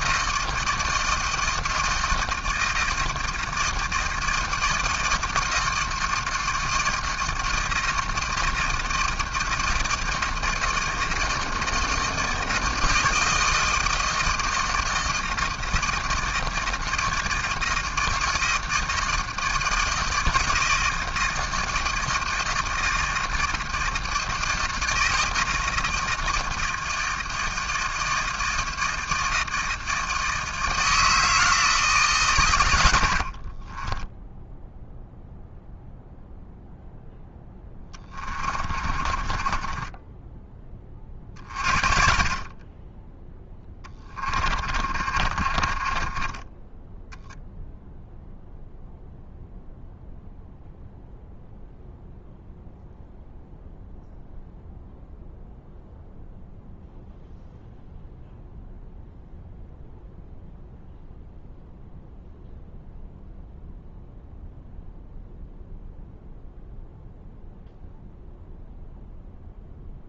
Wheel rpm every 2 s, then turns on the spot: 160, 160, 160, 160, 160, 160, 160, 160, 160, 160, 160, 160, 160, 160, 160, 160, 60, 0, 0, 30, 40, 10, 40, 0, 0, 0, 0, 0, 0, 0, 0, 0, 0, 0, 0.
32-34 38-46